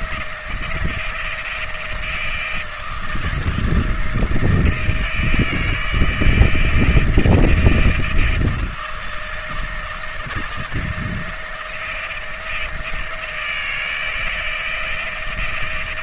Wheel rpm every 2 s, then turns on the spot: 160, 160, 170, 170, 160, 170, 160, 160.
none